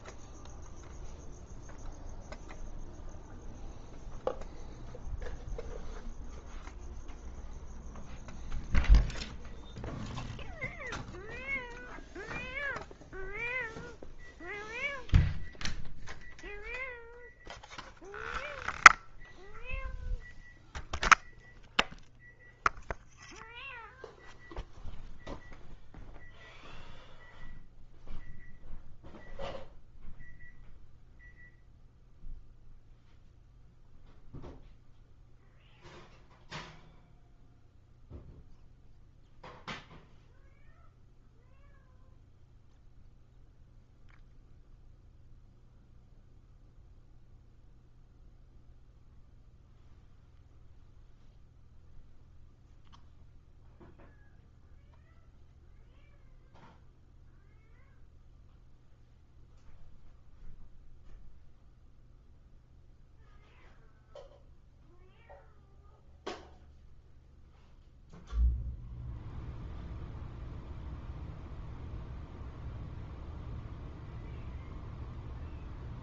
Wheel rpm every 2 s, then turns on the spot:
0, 0, 0, 0, 0, 0, 0, 0, 0, 0, 0, 0, 0, 0, 0, 0, 0, 0, 0, 0, 0, 0, 0, 0, 0, 0, 0, 0, 0, 0, 0, 0, 0, 0, 0, 0, 0, 0.
none